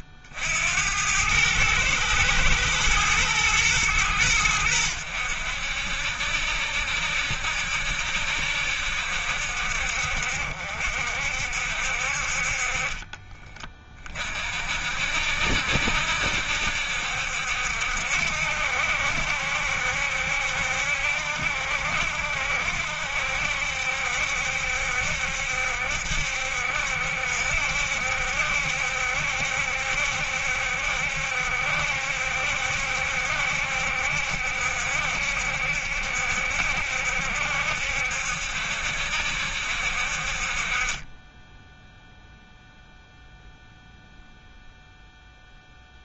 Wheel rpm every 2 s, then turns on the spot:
80, 110, 70, 60, 70, 60, 40, 50, 70, 70, 70, 70, 70, 70, 70, 70, 70, 70, 70, 70, 40, 0, 0.
none